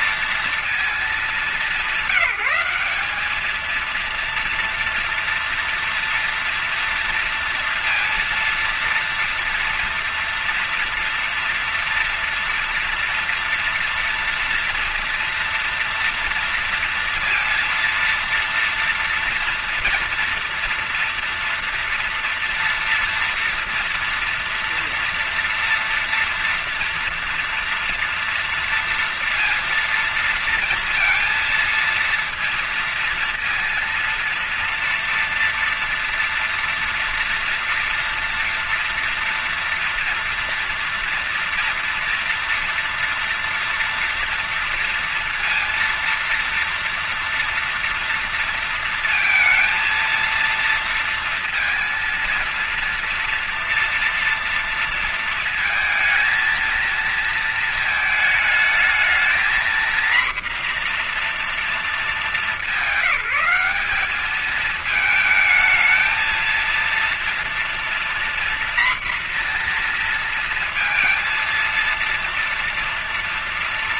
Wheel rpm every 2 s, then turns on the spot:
230, 210, 230, 230, 230, 230, 230, 230, 230, 230, 240, 240, 230, 230, 230, 230, 230, 230, 230, 230, 230, 240, 230, 230, 230, 230, 230, 230, 220, 220, 240, 190, 210, 230, 240, 230, 230.
none